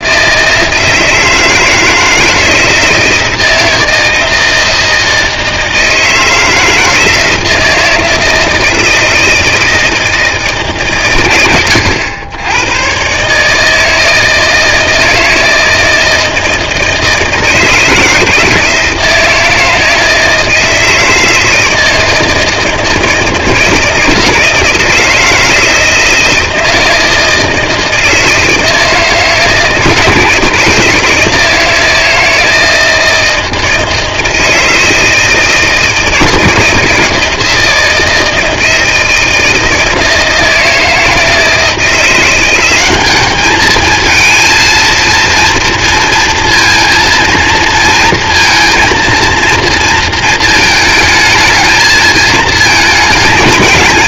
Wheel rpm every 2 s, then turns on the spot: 160, 160, 160, 160, 160, 140, 120, 160, 160, 160, 160, 160, 160, 160, 160, 160, 160, 160, 160, 160, 160, 190, 230, 230, 230, 220, 220.
none